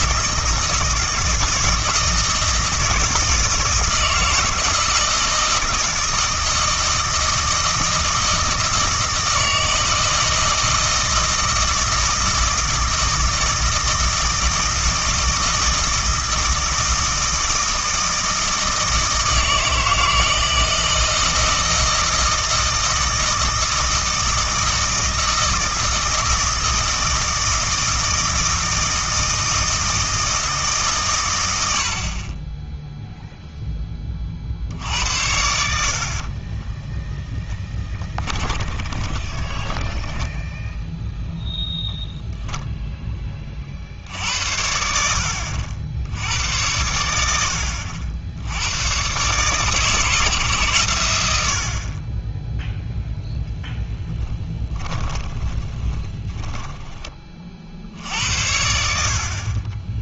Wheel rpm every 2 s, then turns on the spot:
170, 160, 160, 160, 160, 160, 160, 160, 160, 160, 160, 160, 160, 160, 160, 140, 0, 80, 10, 20, 0, 10, 70, 90, 120, 110, 0, 20, 20, 70.
36-40 54-56